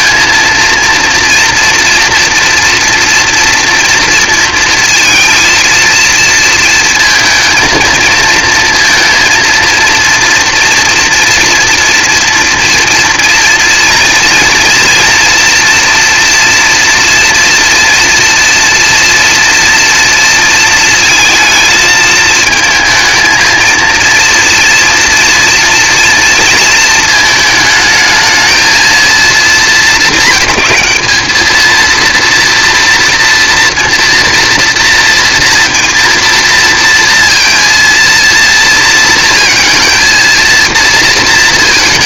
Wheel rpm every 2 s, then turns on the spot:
230, 230, 220, 220, 230, 240, 240, 240, 230, 230, 230, 220, 230, 220, 230, 210, 230, 230, 230, 230, 230.
none